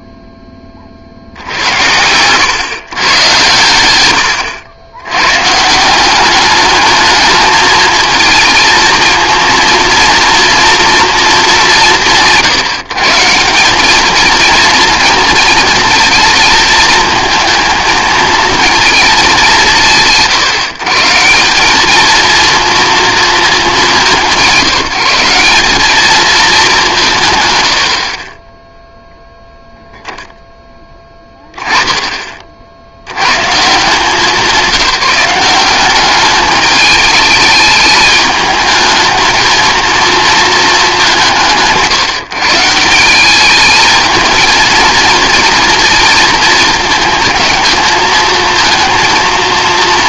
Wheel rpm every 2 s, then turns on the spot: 0, 140, 130, 210, 220, 230, 130, 230, 230, 230, 130, 230, 170, 190, 0, 10, 60, 190, 210, 220, 210, 170, 220, 220, 230.
none